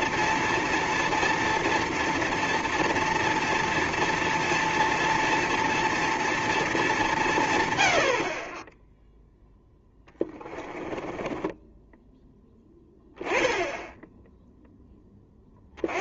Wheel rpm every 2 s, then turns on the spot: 230, 230, 230, 220, 20, 20, 10, 0.
10-12